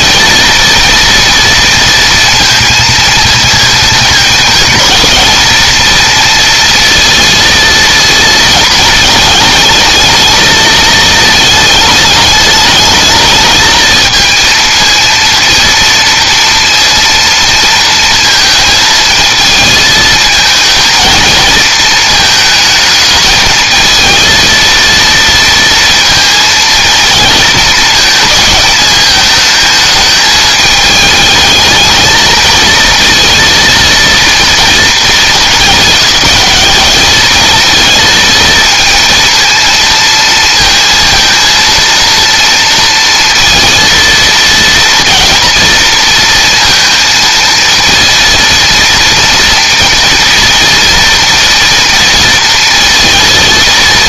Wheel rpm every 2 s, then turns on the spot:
230, 230, 220, 230, 220, 220, 210, 220, 230, 220, 230, 220, 230, 230, 220, 210, 220, 230, 200, 230, 230, 230, 230, 230, 230, 230, 230.
none